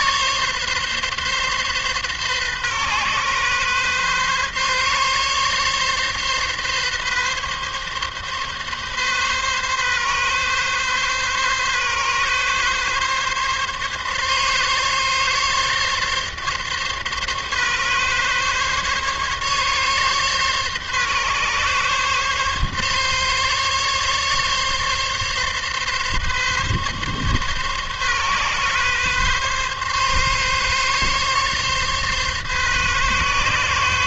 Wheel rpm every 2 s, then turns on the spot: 140, 130, 140, 140, 140, 140, 140, 140, 140, 140, 140, 140, 140, 140, 130, 140, 140.
none